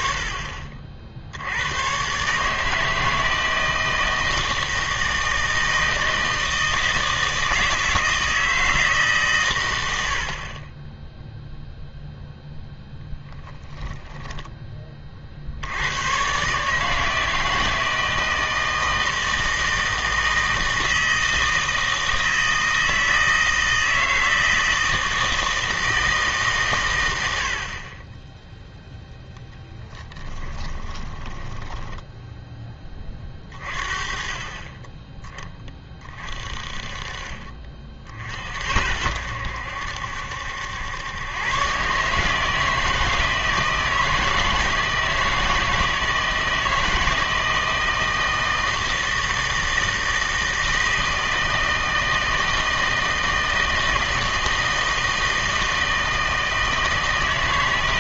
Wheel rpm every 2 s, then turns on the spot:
50, 160, 160, 160, 160, 20, 0, 20, 150, 160, 160, 160, 160, 120, 0, 20, 20, 20, 40, 70, 90, 160, 160, 160, 160, 160, 160, 160, 160.
30-32